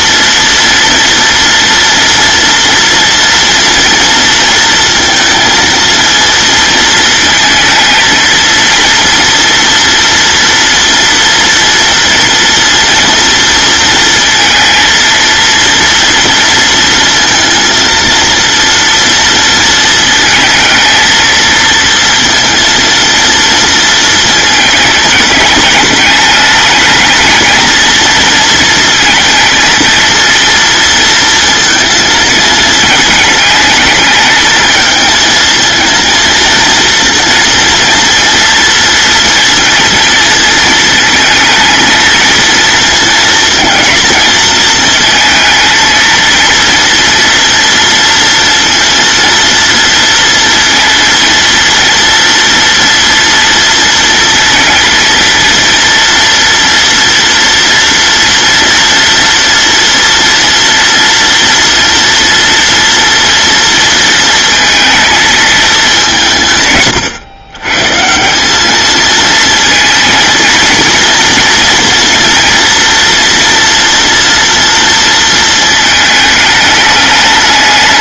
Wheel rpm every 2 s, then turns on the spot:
230, 230, 230, 230, 230, 230, 230, 230, 230, 230, 230, 230, 210, 220, 230, 230, 220, 220, 230, 230, 220, 230, 220, 230, 230, 230, 230, 230, 230, 230, 230, 230, 230, 140, 210, 230, 230, 230, 210.
none